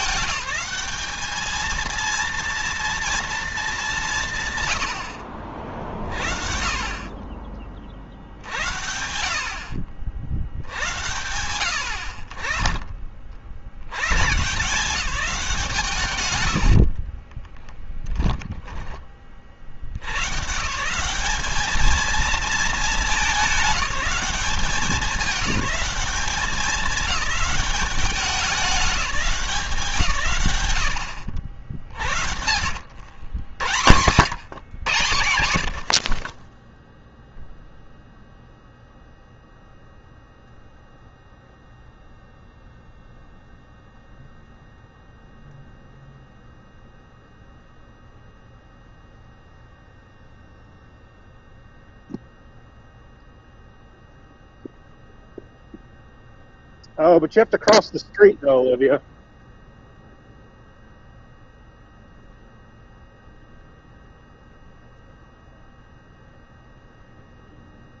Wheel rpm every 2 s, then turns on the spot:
210, 230, 160, 50, 70, 80, 20, 160, 100, 20, 140, 220, 180, 200, 200, 120, 80, 120, 10, 0, 0, 0, 0, 0, 0, 0, 0, 0, 0, 0, 0, 0, 0, 0.
16-20